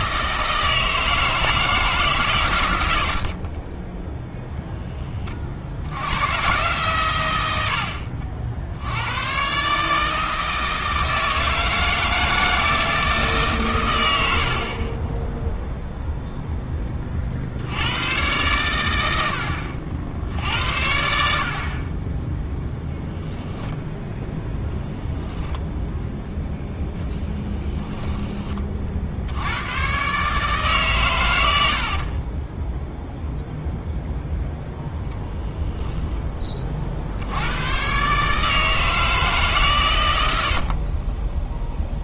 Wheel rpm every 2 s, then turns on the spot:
160, 80, 10, 130, 80, 160, 160, 40, 10, 110, 70, 0, 0, 0, 40, 130, 0, 10, 50, 160, 40.
34-36 40-42